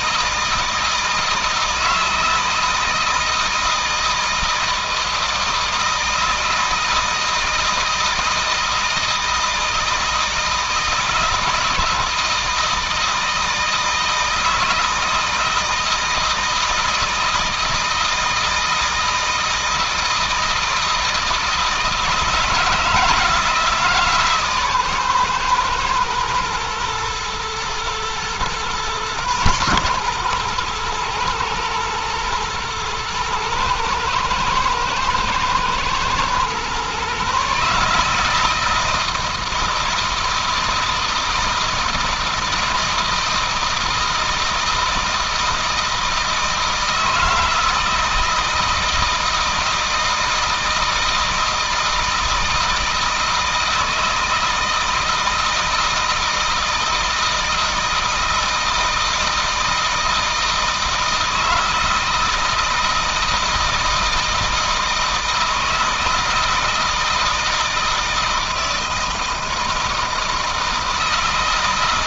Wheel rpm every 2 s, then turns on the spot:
160, 160, 160, 160, 160, 160, 160, 160, 160, 160, 160, 160, 130, 120, 120, 120, 120, 110, 130, 160, 160, 160, 160, 160, 170, 160, 160, 160, 160, 160, 160, 160, 160, 160, 160, 160.
none